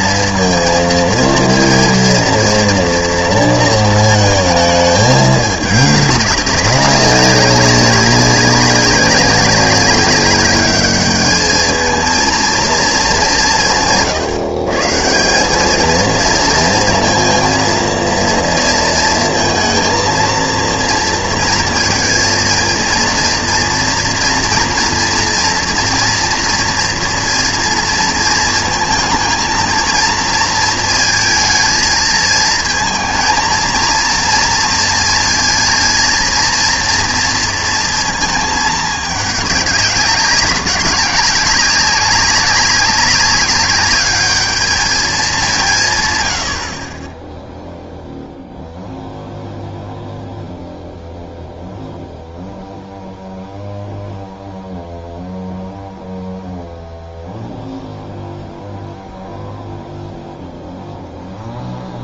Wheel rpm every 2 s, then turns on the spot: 230, 230, 220, 200, 190, 200, 230, 150, 230, 230, 230, 230, 240, 240, 230, 230, 220, 230, 230, 220, 200, 200, 210, 40, 0, 0, 0, 0, 0, 0, 0.
none